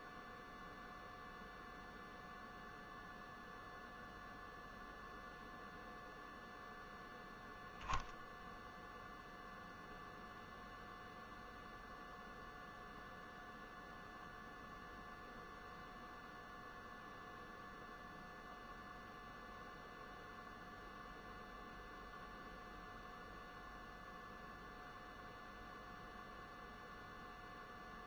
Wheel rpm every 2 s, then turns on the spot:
0, 0, 0, 0, 0, 0, 0, 0, 0, 0, 0, 0, 0, 0.
none